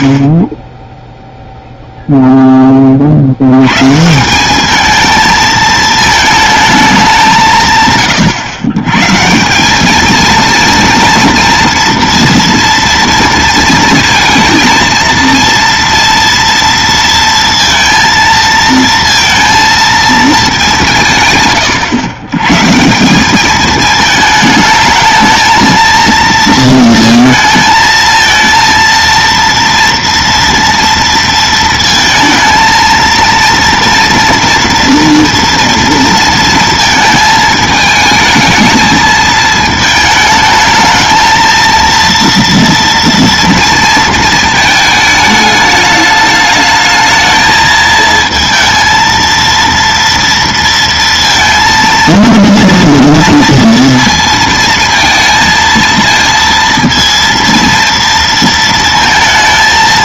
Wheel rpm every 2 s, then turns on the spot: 0, 130, 220, 150, 200, 230, 230, 230, 230, 230, 110, 210, 230, 230, 230, 230, 230, 230, 220, 220, 230, 230, 210, 220, 230, 230, 230, 220, 230, 230.
none